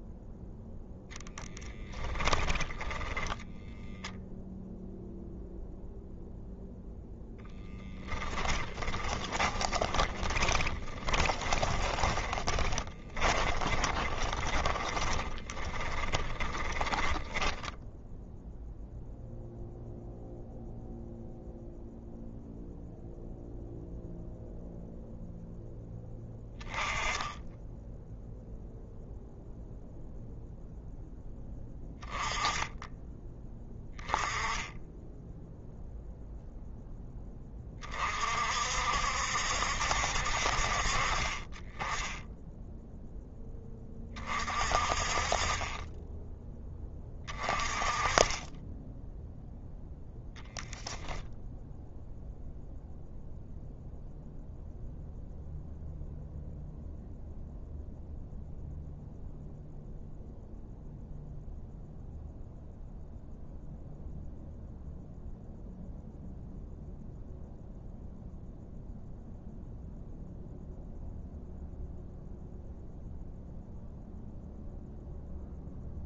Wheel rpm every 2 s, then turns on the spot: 10, 20, 0, 0, 20, 20, 20, 20, 20, 0, 0, 0, 0, 10, 0, 0, 10, 10, 0, 60, 50, 0, 40, 20, 10, 0, 0, 0, 0, 0, 0, 0, 0, 0, 0, 0, 0, 0.
0-4 8-18